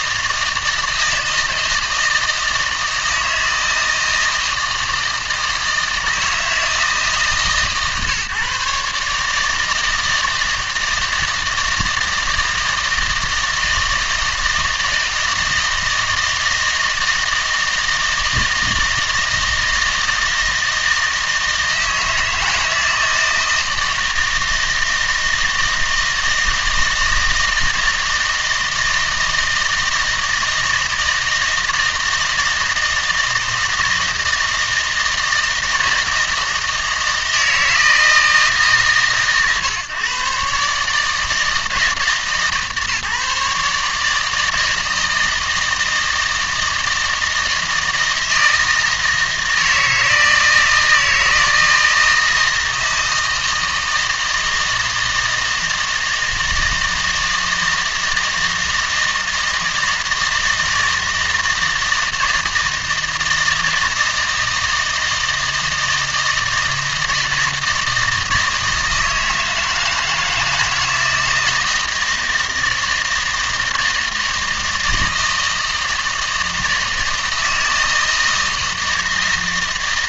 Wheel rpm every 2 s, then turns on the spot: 160, 160, 160, 160, 150, 160, 160, 160, 160, 160, 160, 160, 160, 160, 160, 160, 160, 160, 160, 140, 150, 150, 160, 160, 160, 160, 160, 160, 160, 160, 160, 160, 160, 160, 160, 160, 160, 160, 160, 160.
none